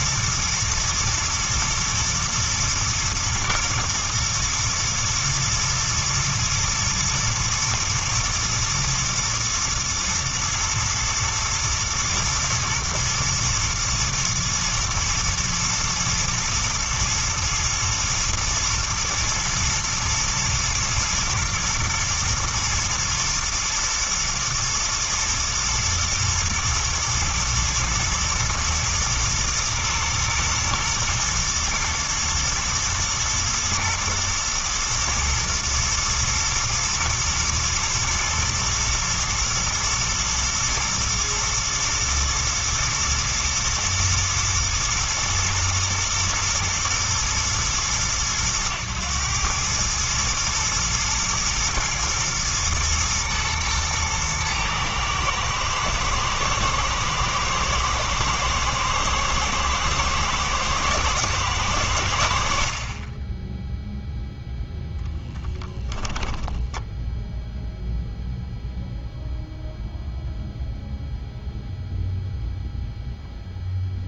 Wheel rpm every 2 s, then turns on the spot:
120, 120, 120, 120, 120, 110, 110, 110, 110, 120, 110, 120, 110, 110, 120, 120, 110, 110, 110, 120, 120, 110, 110, 120, 110, 120, 120, 110, 110, 110, 120, 40, 0, 10, 0, 0, 0.
none